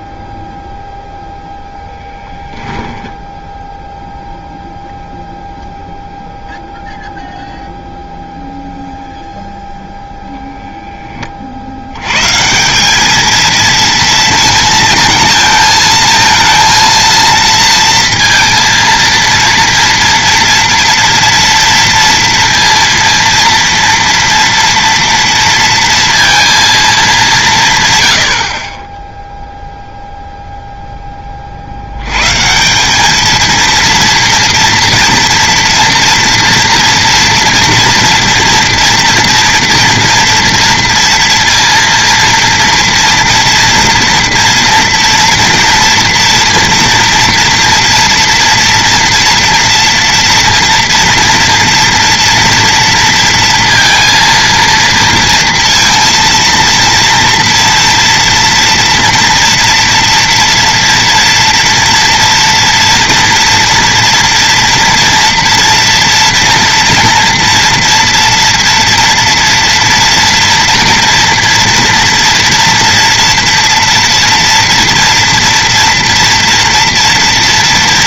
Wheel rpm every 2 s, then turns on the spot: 0, 10, 0, 0, 0, 10, 190, 220, 230, 230, 230, 230, 230, 220, 30, 0, 180, 240, 230, 240, 230, 230, 230, 230, 230, 230, 230, 230, 230, 240, 230, 240, 230, 230, 230, 230, 240, 230, 230.
2-4